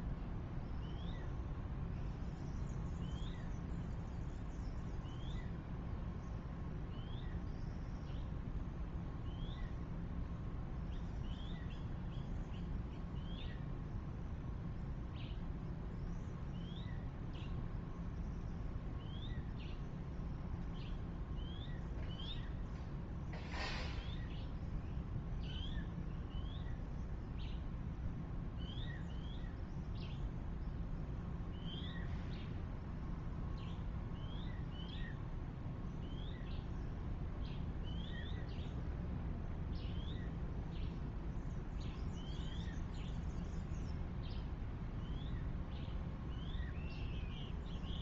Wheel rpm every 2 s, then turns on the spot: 0, 0, 0, 0, 0, 0, 0, 0, 0, 0, 0, 0, 0, 0, 0, 0, 0, 0, 0, 0, 0, 0, 0, 0.
none